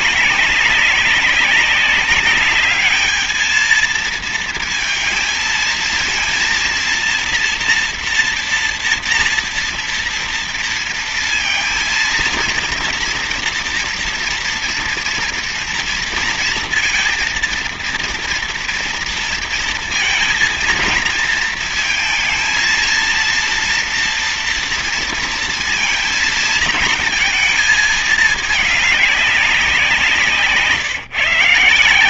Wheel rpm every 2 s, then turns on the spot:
200, 210, 230, 230, 240, 230, 230, 230, 230, 230, 230, 230, 230, 230, 210, 160.
none